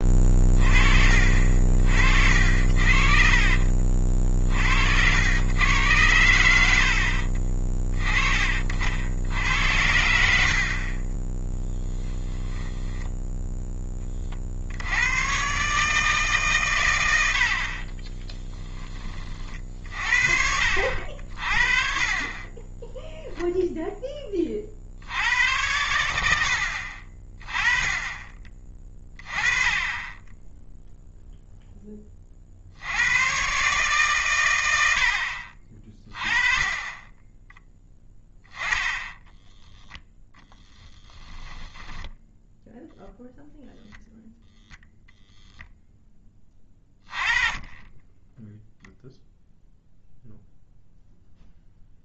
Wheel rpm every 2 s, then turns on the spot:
30, 60, 50, 80, 40, 50, 10, 50, 140, 10, 60, 20, 40, 70, 30, 10, 60, 100, 20, 10, 10, 0, 0, 20, 0, 0.
12-14 38-40